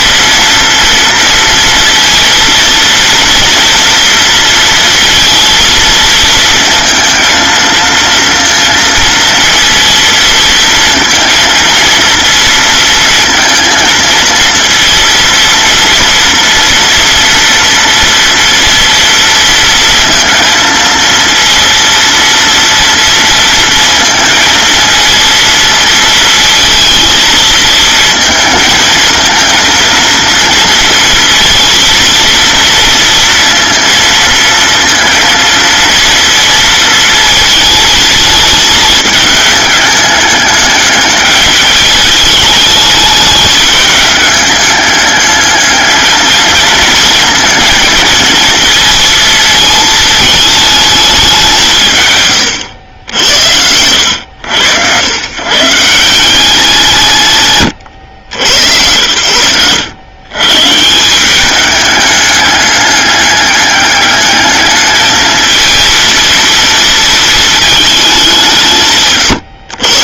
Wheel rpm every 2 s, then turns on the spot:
230, 230, 230, 230, 230, 230, 230, 230, 230, 230, 230, 230, 220, 220, 220, 220, 230, 230, 230, 220, 210, 210, 210, 230, 220, 200, 90, 110, 150, 90, 180, 200, 220, 230, 160.
52-54